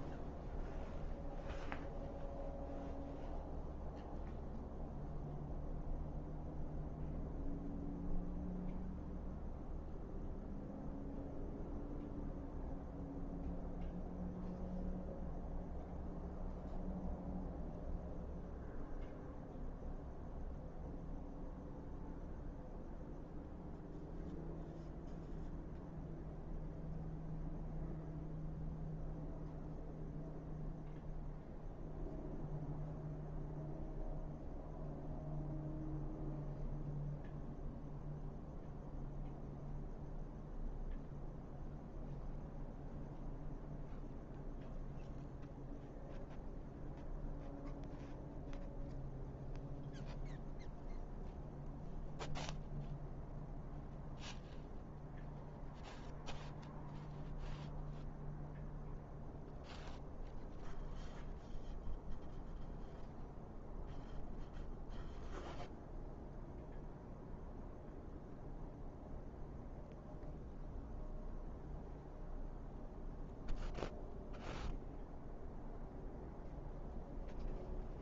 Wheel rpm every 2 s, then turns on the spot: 0, 0, 0, 0, 0, 0, 0, 0, 0, 0, 0, 0, 0, 0, 0, 0, 0, 0, 0, 0, 0, 0, 0, 0, 0, 0, 0, 0, 0, 0, 0, 0, 0, 0, 0, 0, 0, 0, 0.
none